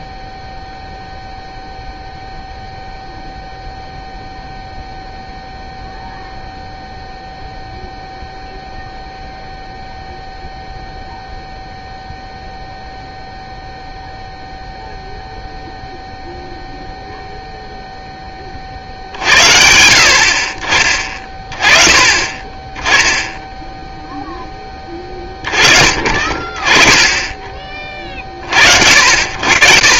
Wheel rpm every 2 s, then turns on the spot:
0, 0, 0, 0, 0, 0, 0, 0, 0, 40, 40, 20, 20, 30, 60.
none